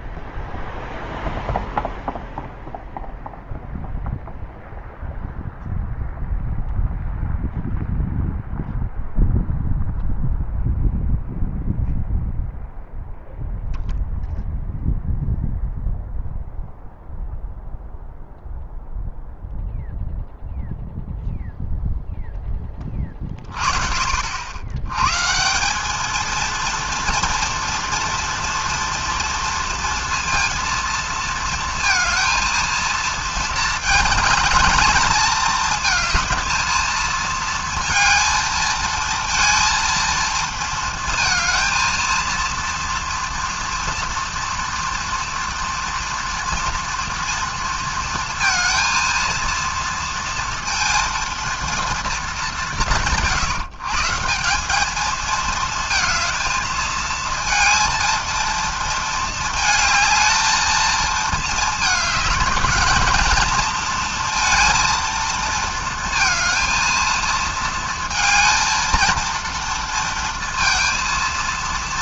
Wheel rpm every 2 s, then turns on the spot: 0, 0, 0, 0, 0, 0, 0, 0, 0, 0, 0, 20, 100, 230, 230, 230, 220, 210, 220, 230, 230, 230, 230, 230, 230, 230, 190, 200, 220, 220, 220, 220, 230, 230, 230, 230.
none